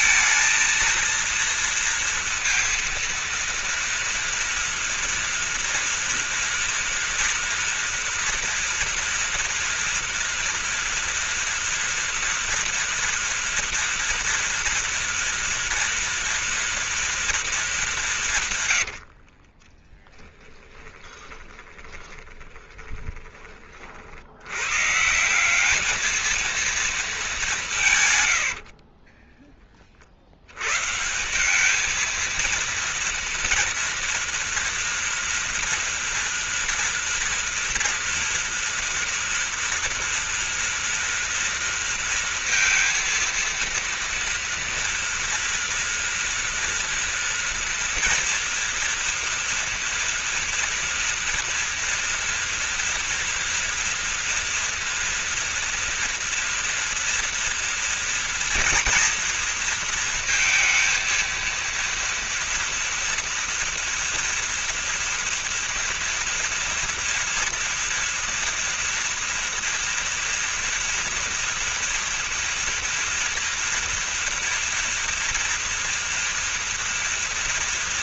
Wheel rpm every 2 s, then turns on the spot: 230, 230, 230, 240, 230, 240, 230, 230, 230, 170, 10, 20, 70, 220, 120, 80, 230, 230, 240, 230, 230, 230, 230, 230, 230, 230, 230, 230, 230, 230, 230, 230, 230, 230, 230, 230, 230, 230, 230.
20-24